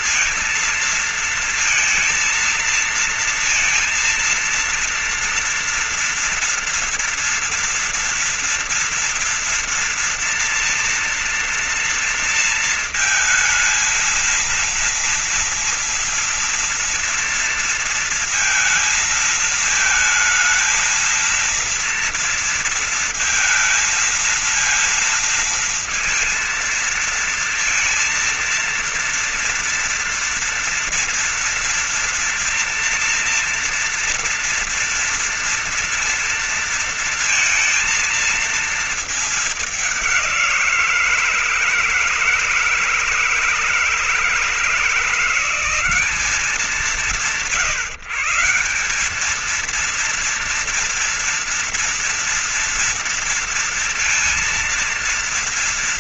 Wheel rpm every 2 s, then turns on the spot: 230, 230, 230, 230, 230, 230, 230, 230, 230, 230, 230, 230, 230, 230, 230, 230, 230, 230, 230, 220, 190, 160, 160, 180, 150, 230, 230, 230.
none